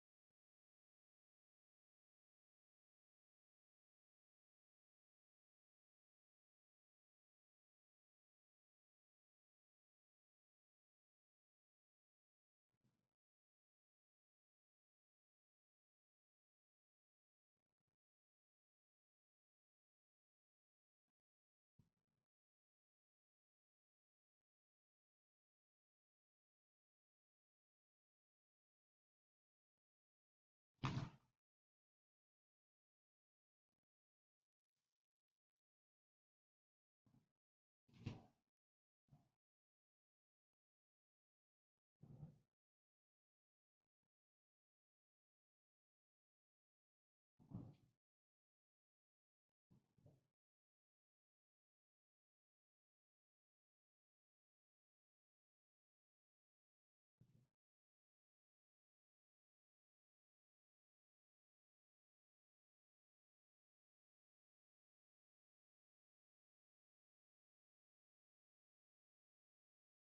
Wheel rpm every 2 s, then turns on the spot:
0, 0, 0, 0, 0, 0, 0, 0, 0, 0, 0, 0, 0, 0, 0, 0, 0, 0, 0, 0, 0, 0, 0, 0, 0, 0, 0, 0, 0, 0, 0, 0, 0, 0, 0.
none